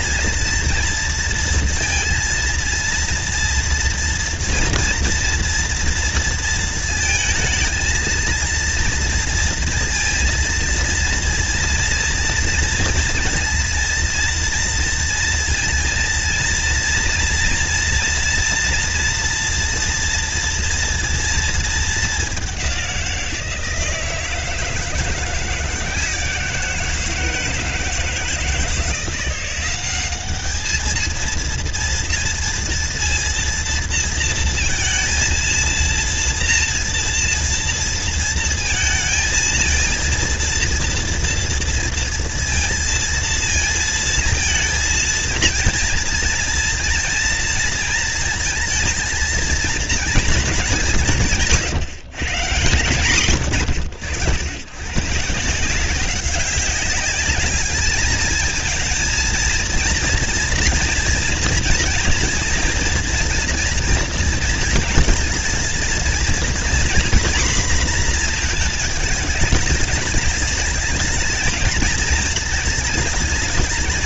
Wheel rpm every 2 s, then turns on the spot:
230, 230, 230, 230, 230, 230, 230, 230, 230, 230, 230, 200, 160, 170, 160, 200, 230, 230, 230, 230, 230, 230, 230, 230, 230, 220, 140, 100, 190, 220, 230, 230, 230, 230, 230, 210, 230.
none